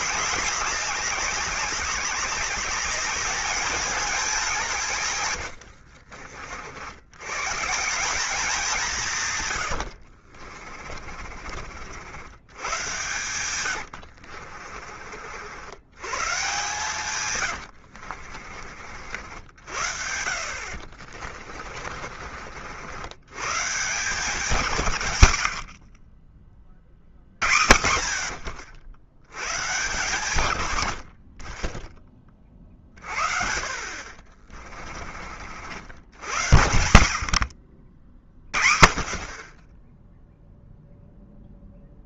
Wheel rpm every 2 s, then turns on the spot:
200, 210, 160, 70, 160, 30, 100, 50, 130, 60, 50, 80, 140, 40, 70, 90, 30, 30, 60, 40, 0.
10-12 14-18 20-22 34-36